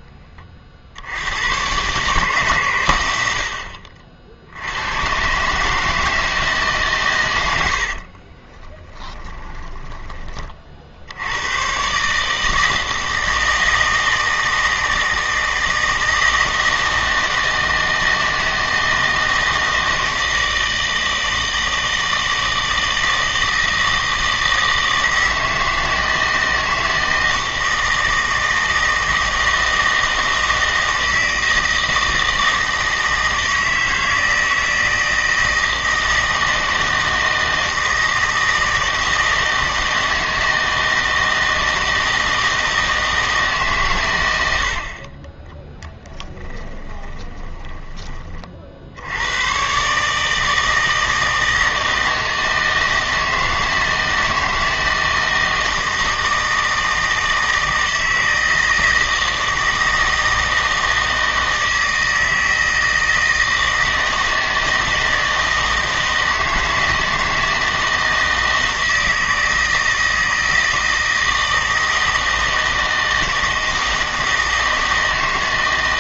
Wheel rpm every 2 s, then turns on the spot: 40, 130, 80, 150, 20, 40, 160, 160, 160, 160, 160, 160, 160, 160, 160, 160, 160, 160, 160, 160, 160, 160, 80, 10, 40, 160, 160, 160, 160, 160, 160, 160, 160, 160, 160, 160, 160, 160.
8-10 46-48